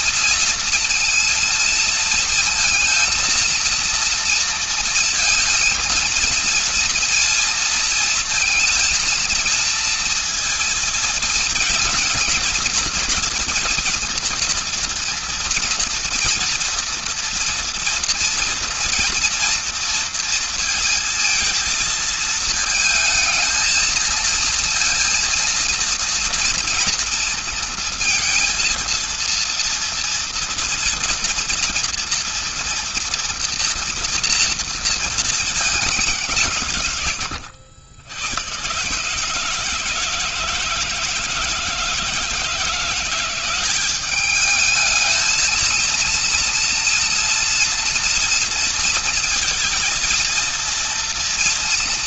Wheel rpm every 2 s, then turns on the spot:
230, 230, 230, 230, 230, 230, 230, 230, 230, 230, 230, 220, 230, 230, 230, 230, 240, 220, 90, 150, 160, 180, 220, 230, 230, 230.
none